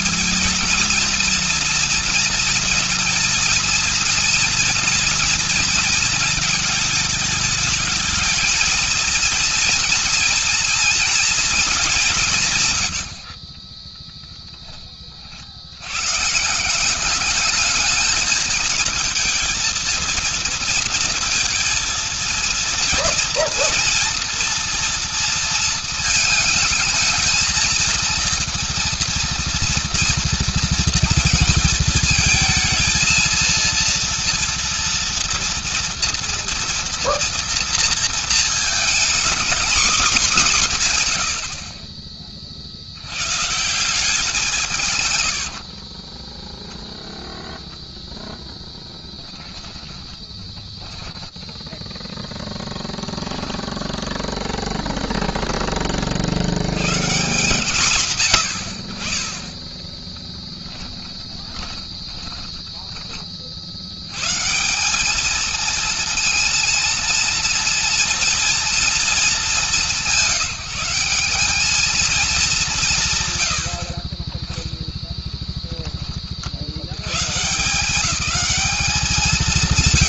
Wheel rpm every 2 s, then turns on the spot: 220, 230, 230, 220, 220, 230, 170, 10, 140, 220, 230, 230, 230, 220, 230, 230, 220, 230, 230, 230, 220, 30, 170, 20, 0, 10, 0, 0, 90, 130, 10, 20, 130, 230, 240, 170, 220, 30, 40, 190.
46-48 50-52 60-64